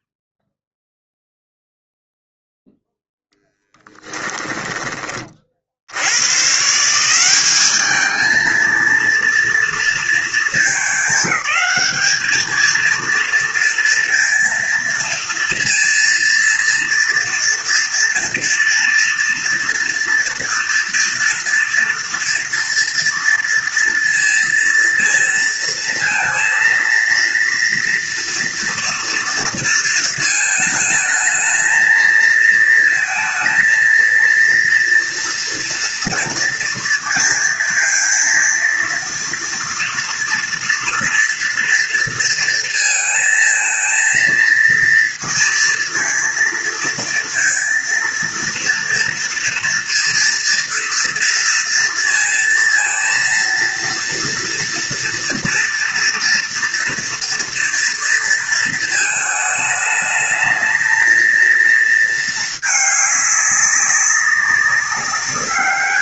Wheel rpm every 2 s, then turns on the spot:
0, 0, 20, 160, 230, 200, 230, 230, 240, 240, 230, 230, 230, 230, 230, 220, 230, 230, 230, 230, 230, 220, 230, 230, 230, 230, 230, 230, 230, 220, 230, 210, 200.
none